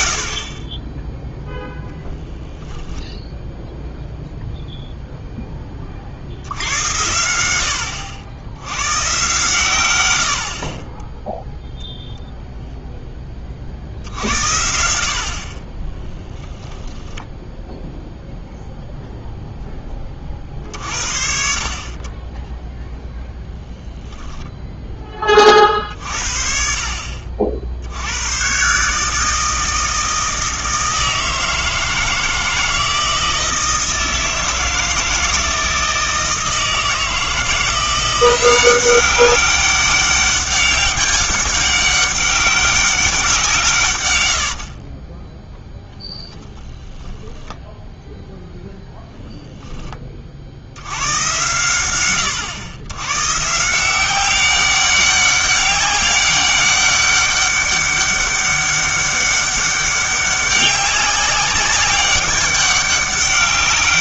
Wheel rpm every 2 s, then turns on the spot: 20, 0, 0, 90, 110, 30, 0, 70, 0, 0, 50, 0, 0, 50, 140, 160, 160, 160, 160, 190, 200, 200, 40, 10, 0, 80, 110, 200, 200, 200, 200, 200.
44-46